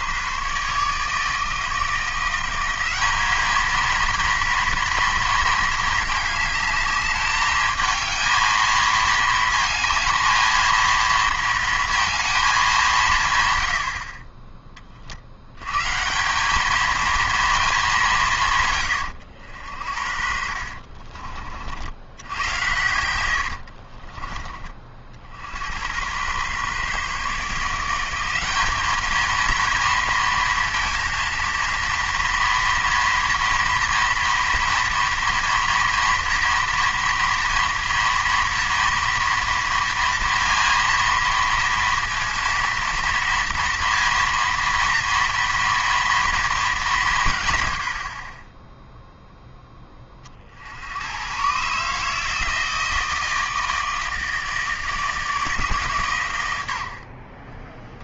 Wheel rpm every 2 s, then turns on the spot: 150, 180, 230, 210, 220, 230, 210, 30, 200, 130, 60, 100, 40, 130, 200, 230, 230, 230, 230, 240, 230, 230, 230, 220, 20, 60, 160, 160, 90.
20-22